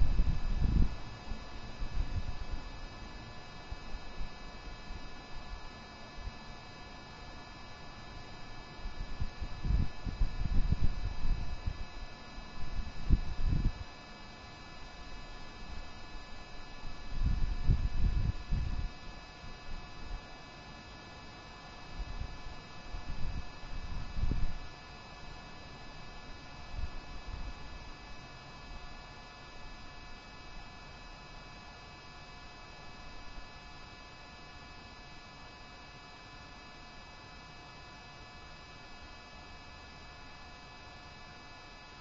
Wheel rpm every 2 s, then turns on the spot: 0, 0, 0, 0, 0, 0, 0, 0, 0, 0, 0, 0, 0, 0, 0, 0, 0, 0, 0, 0, 0.
none